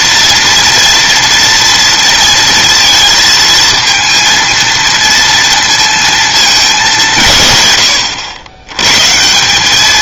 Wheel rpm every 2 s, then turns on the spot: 230, 230, 230, 190, 120.
none